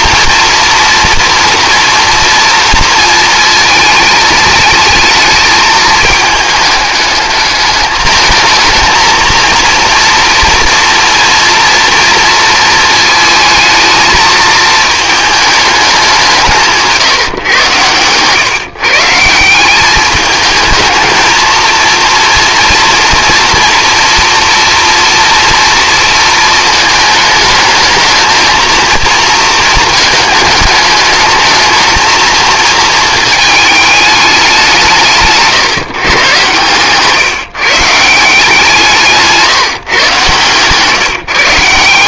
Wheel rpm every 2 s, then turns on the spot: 240, 230, 220, 210, 220, 230, 220, 220, 160, 140, 220, 230, 230, 220, 230, 210, 230, 190, 130, 170, 140.
none